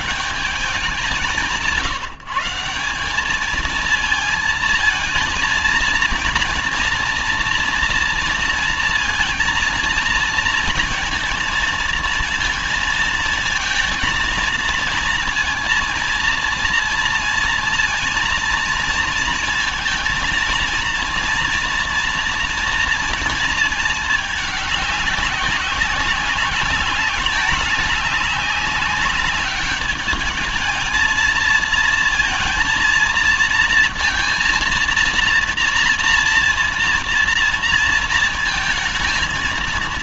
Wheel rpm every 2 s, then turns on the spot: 200, 170, 230, 230, 230, 230, 230, 230, 230, 230, 230, 230, 200, 200, 200, 220, 230, 230, 230, 230.
none